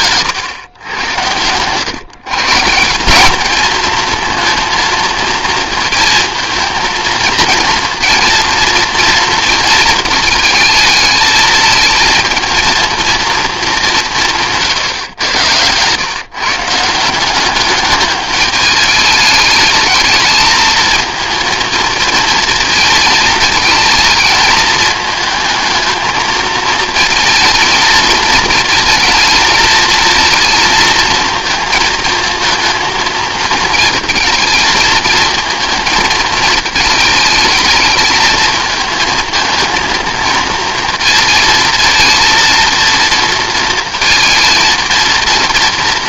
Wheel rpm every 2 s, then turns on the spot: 100, 170, 230, 220, 230, 220, 230, 130, 160, 220, 230, 220, 220, 230, 220, 230, 230, 220, 220, 220, 230, 230, 230.
none